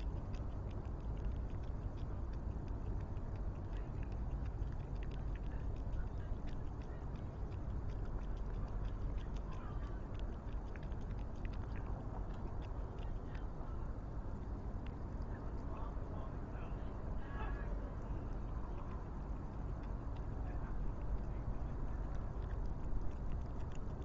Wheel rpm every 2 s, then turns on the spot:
0, 0, 0, 0, 0, 0, 0, 0, 0, 0, 0, 0.
none